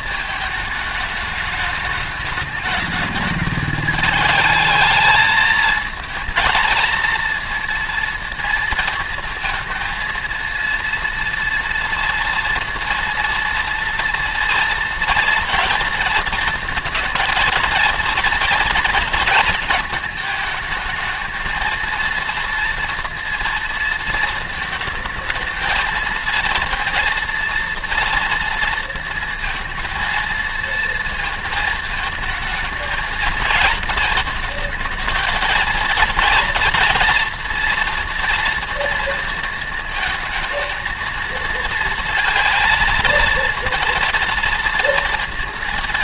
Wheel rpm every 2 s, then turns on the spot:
210, 210, 210, 230, 230, 230, 230, 230, 230, 230, 220, 230, 220, 230, 230, 230, 220, 220, 230, 230, 220, 230, 230.
none